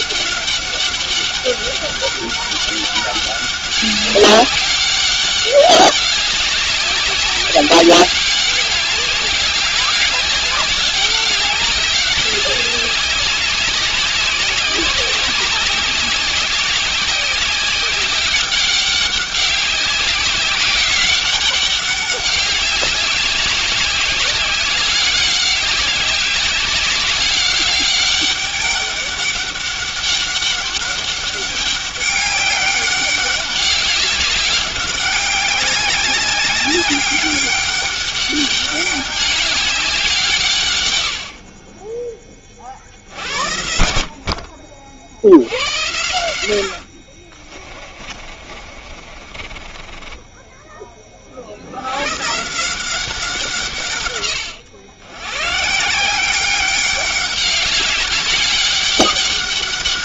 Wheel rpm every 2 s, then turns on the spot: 200, 200, 200, 200, 200, 200, 200, 190, 190, 190, 190, 190, 200, 200, 200, 200, 200, 190, 200, 200, 110, 60, 50, 60, 40, 20, 180, 110, 200, 200.
46-50